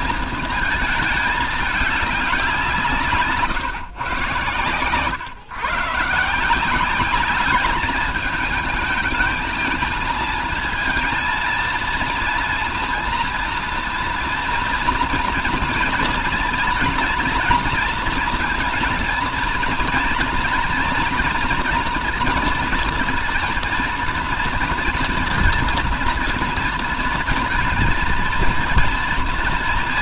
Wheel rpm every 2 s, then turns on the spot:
220, 180, 110, 170, 210, 230, 230, 230, 240, 240, 240, 230, 230, 230, 230.
none